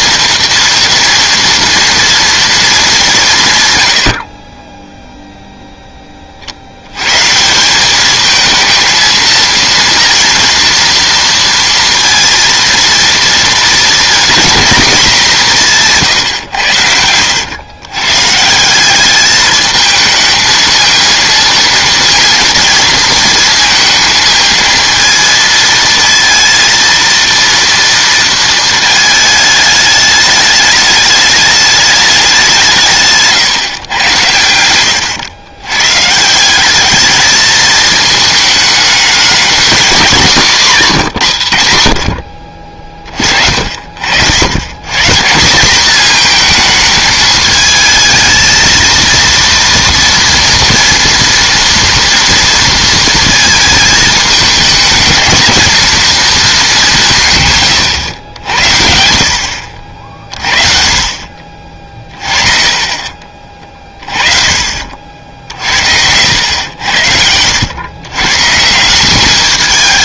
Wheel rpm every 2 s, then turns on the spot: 230, 220, 30, 50, 220, 230, 230, 230, 100, 160, 220, 230, 230, 230, 230, 210, 180, 100, 190, 220, 200, 50, 100, 220, 230, 230, 230, 220, 210, 70, 40, 30, 50, 100, 150.
62-64